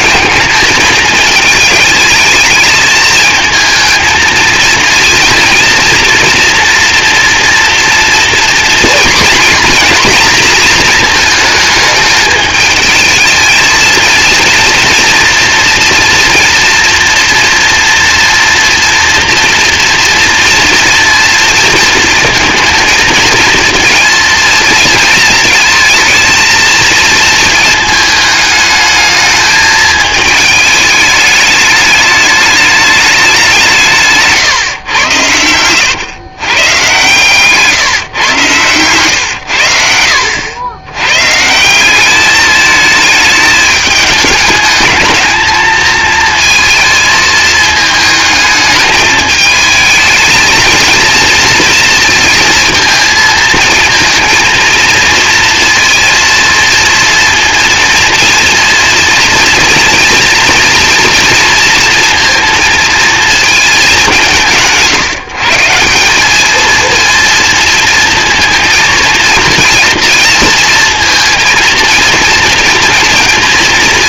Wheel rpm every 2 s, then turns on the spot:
220, 220, 230, 240, 240, 230, 220, 230, 230, 230, 240, 230, 230, 230, 210, 210, 210, 110, 130, 120, 100, 210, 210, 220, 210, 230, 230, 230, 230, 230, 240, 230, 170, 230, 230, 220, 230.
none